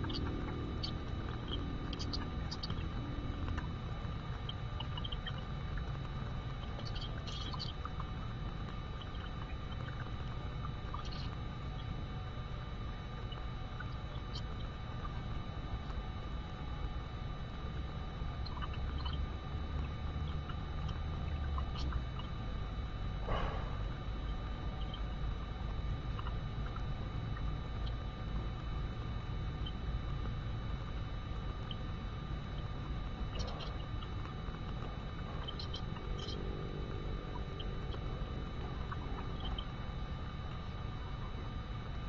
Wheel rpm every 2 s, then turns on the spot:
0, 0, 0, 0, 0, 0, 0, 0, 0, 0, 0, 0, 0, 0, 0, 0, 0, 0, 0, 0, 0.
none